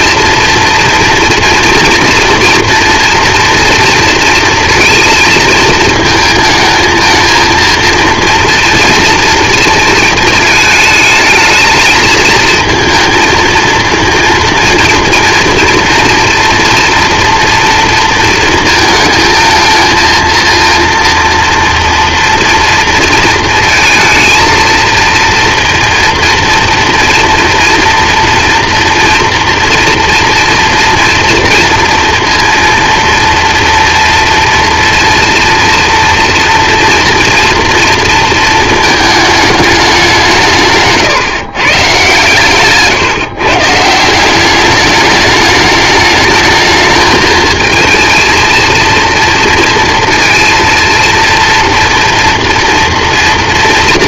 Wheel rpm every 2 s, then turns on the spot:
230, 230, 230, 230, 230, 220, 230, 230, 230, 230, 230, 230, 230, 230, 230, 230, 230, 240, 230, 230, 180, 140, 190, 220, 230, 230, 230.
none